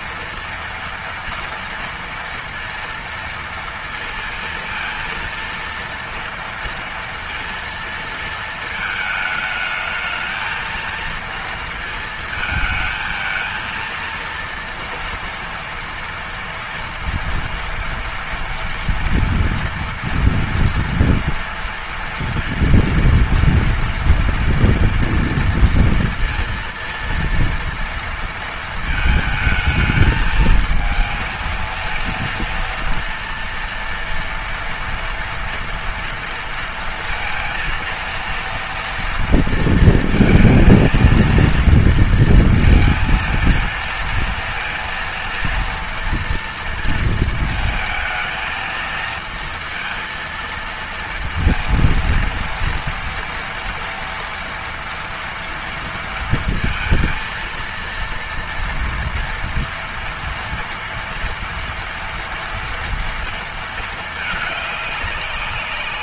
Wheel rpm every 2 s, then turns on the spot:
230, 230, 230, 230, 230, 220, 230, 230, 230, 240, 240, 230, 230, 230, 230, 220, 230, 230, 230, 230, 230, 230, 230, 230, 220, 230, 230, 230, 230, 230, 230, 230, 210.
none